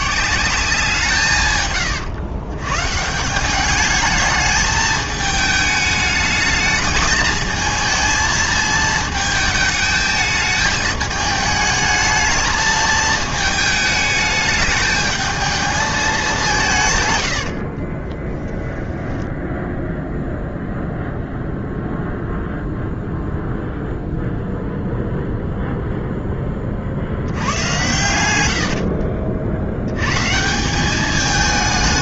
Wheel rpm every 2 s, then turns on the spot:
180, 130, 220, 220, 220, 210, 220, 210, 150, 10, 0, 0, 0, 40, 70, 180.
18-20 28-30